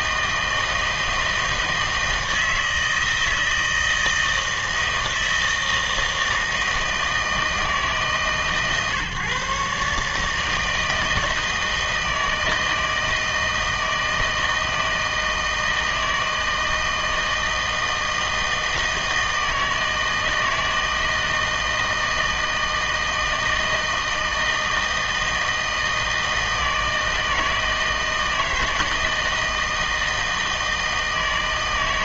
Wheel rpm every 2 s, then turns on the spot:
160, 160, 160, 160, 140, 160, 160, 160, 160, 160, 160, 160, 160, 160, 160, 160.
none